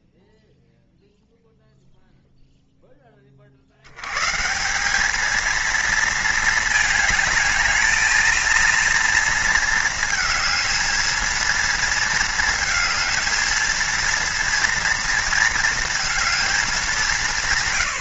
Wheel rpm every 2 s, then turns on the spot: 0, 0, 150, 220, 230, 220, 220, 230, 220.
none